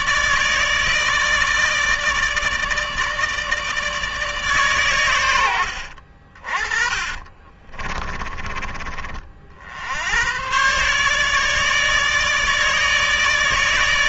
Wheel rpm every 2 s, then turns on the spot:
160, 150, 110, 30, 40, 140, 150.
6-8